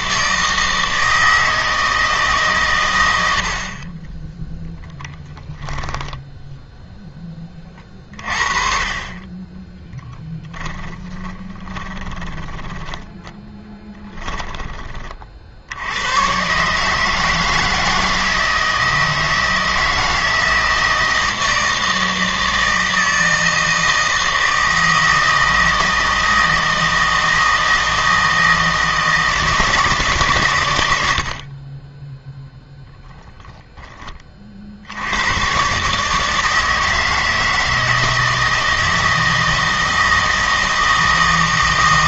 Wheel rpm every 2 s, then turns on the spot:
160, 120, 10, 0, 30, 30, 10, 20, 150, 160, 160, 160, 160, 160, 160, 110, 10, 60, 160, 160, 160.
4-6 10-14